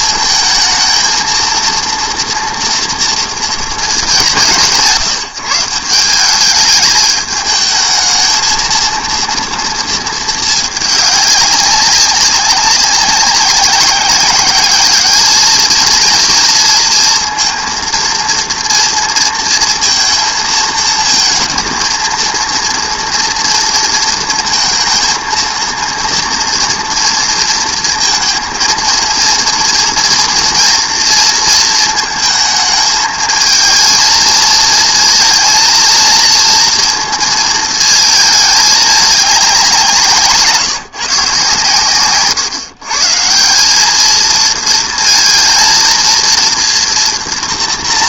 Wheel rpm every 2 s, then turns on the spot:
220, 230, 170, 200, 230, 220, 190, 200, 230, 230, 230, 230, 230, 230, 230, 230, 220, 230, 230, 210, 160, 140, 220, 230.
none